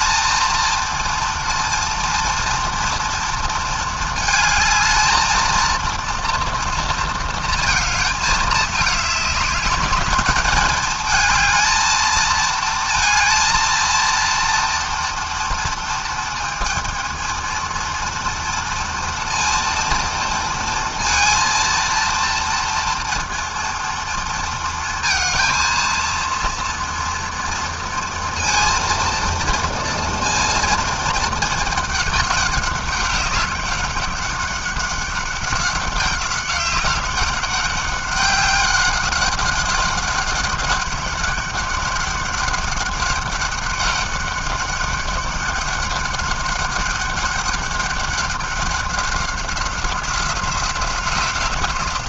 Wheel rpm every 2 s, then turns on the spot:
230, 230, 220, 230, 210, 220, 230, 230, 230, 230, 230, 230, 230, 230, 230, 220, 200, 200, 200, 190, 200, 200, 200, 200, 190, 180.
none